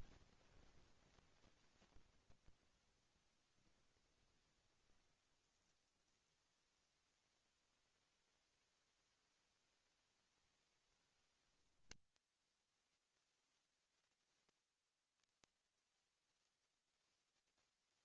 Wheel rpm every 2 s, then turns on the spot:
0, 0, 0, 0, 0, 0, 0, 0, 0.
none